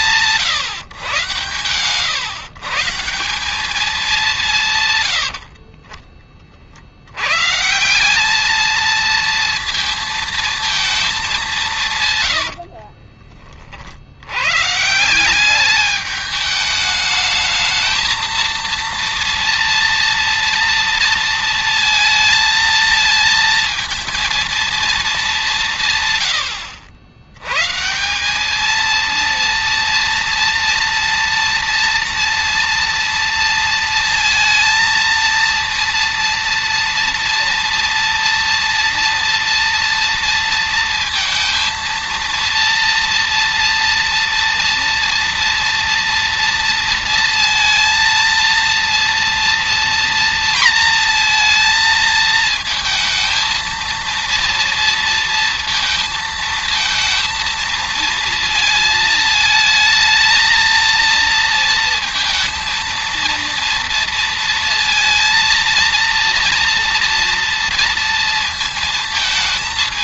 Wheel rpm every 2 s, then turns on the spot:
130, 170, 30, 200, 230, 120, 90, 210, 230, 230, 230, 230, 120, 180, 230, 230, 230, 230, 230, 230, 230, 230, 230, 230, 230, 220, 230, 230, 230, 220, 230, 230, 230, 230, 220.
10-12